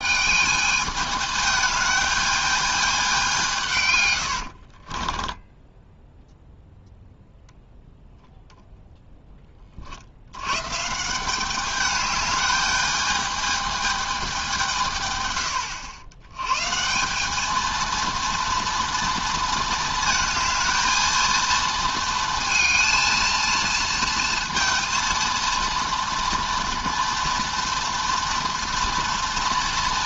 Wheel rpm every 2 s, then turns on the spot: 210, 210, 60, 0, 0, 120, 210, 170, 150, 230, 230, 220, 230, 230, 230.
4-6